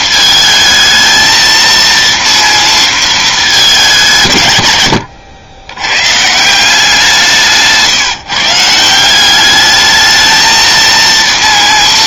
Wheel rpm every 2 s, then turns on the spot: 220, 230, 130, 170, 160, 220.
none